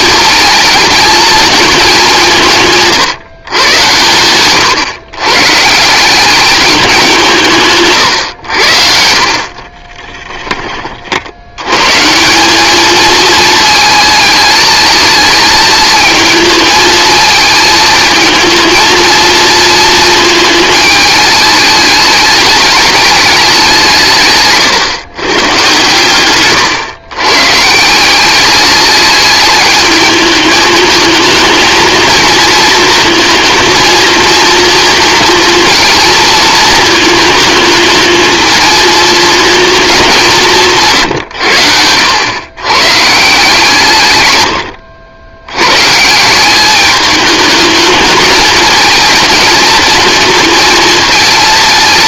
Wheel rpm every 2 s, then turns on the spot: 220, 150, 120, 200, 70, 20, 210, 220, 220, 220, 220, 210, 130, 130, 200, 220, 230, 230, 220, 220, 160, 120, 100, 200, 220, 230.
none